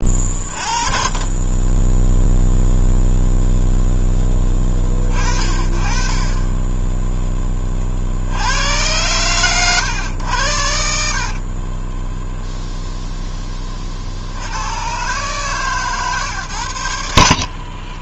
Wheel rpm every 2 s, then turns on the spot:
30, 0, 30, 20, 90, 70, 0, 90, 120.
none